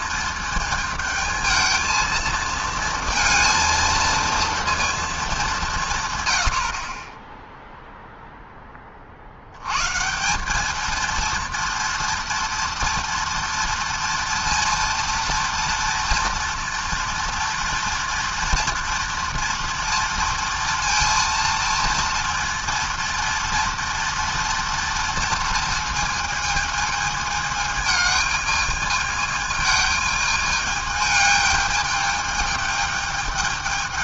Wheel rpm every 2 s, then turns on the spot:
220, 230, 230, 50, 20, 220, 230, 230, 230, 230, 230, 230, 230, 220, 210, 210, 220.
6-8